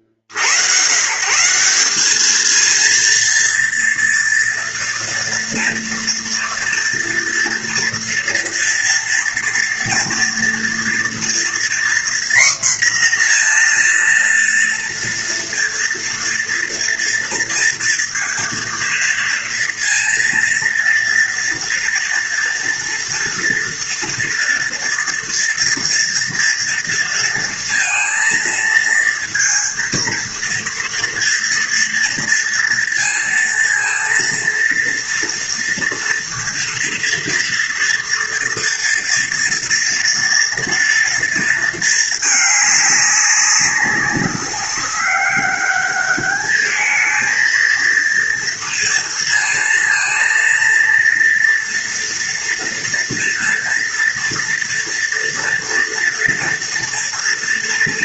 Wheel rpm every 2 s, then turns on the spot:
50, 220, 230, 240, 230, 230, 250, 230, 230, 230, 230, 230, 230, 230, 230, 230, 230, 230, 230, 230, 230, 210, 200, 210, 230, 230, 230, 230, 240.
none